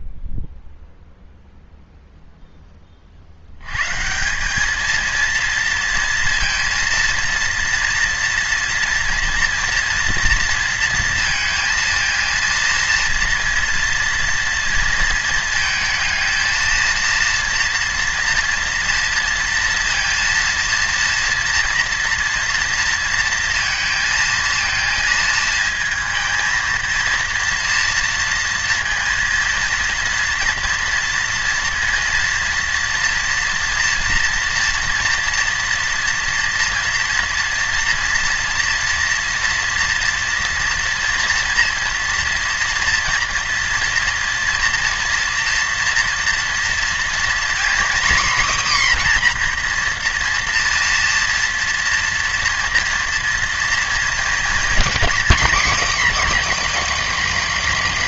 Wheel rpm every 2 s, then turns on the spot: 0, 10, 200, 230, 240, 230, 230, 230, 230, 230, 230, 240, 230, 220, 230, 230, 230, 230, 230, 230, 230, 230, 230, 230, 260, 230, 230, 230, 320.
none